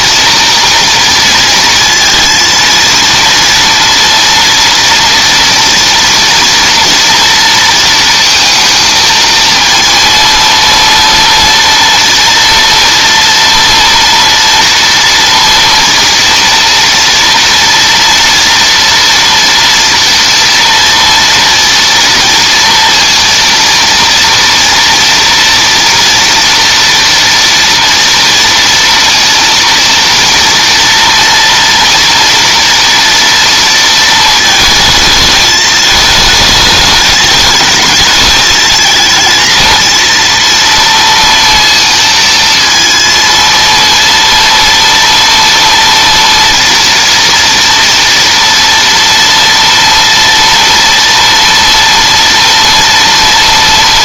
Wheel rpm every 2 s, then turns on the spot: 230, 230, 240, 230, 230, 230, 230, 240, 230, 230, 230, 230, 230, 230, 230, 230, 230, 220, 210, 220, 230, 230, 230, 230, 230, 230, 230.
none